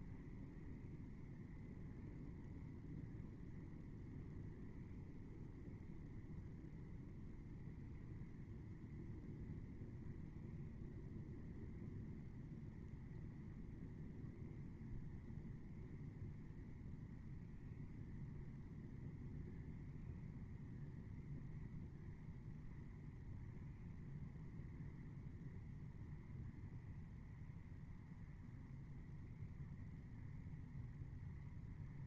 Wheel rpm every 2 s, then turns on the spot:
0, 0, 0, 0, 0, 0, 0, 0, 0, 0, 0, 0, 0, 0, 0, 0.
none